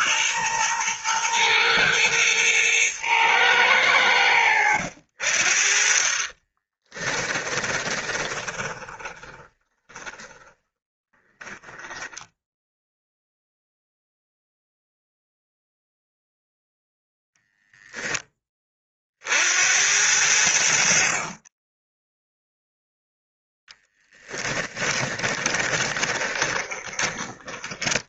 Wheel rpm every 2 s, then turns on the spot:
120, 110, 70, 20, 20, 10, 0, 0, 0, 40, 50, 0, 20, 20.
6-10 24-28